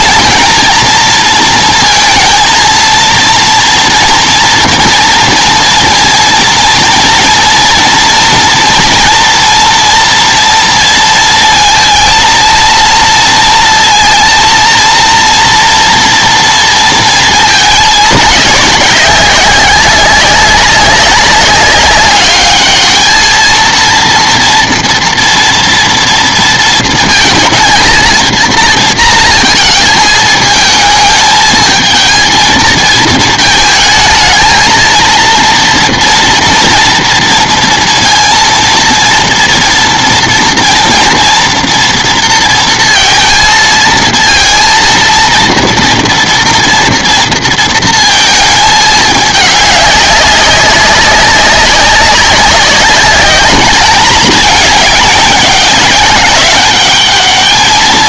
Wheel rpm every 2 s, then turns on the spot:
220, 230, 230, 230, 240, 230, 230, 230, 230, 200, 200, 210, 230, 230, 230, 220, 220, 230, 230, 230, 230, 230, 230, 230, 210, 190, 200, 210, 200.
none